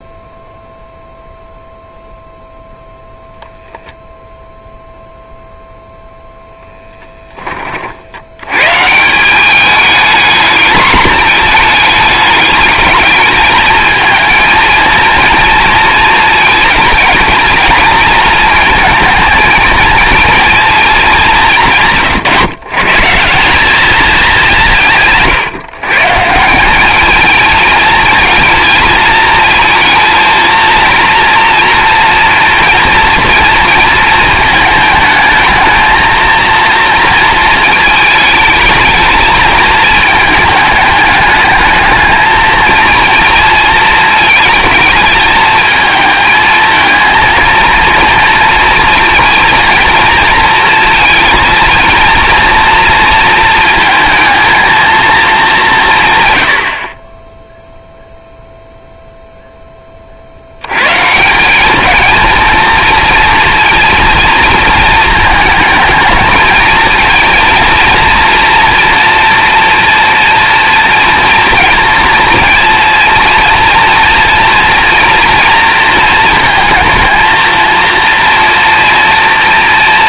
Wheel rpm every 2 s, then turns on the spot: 0, 0, 0, 0, 110, 220, 210, 230, 230, 220, 230, 150, 170, 190, 220, 230, 230, 220, 230, 220, 210, 220, 220, 220, 230, 230, 230, 230, 80, 0, 110, 230, 230, 220, 240, 240, 230, 230, 230, 230.
none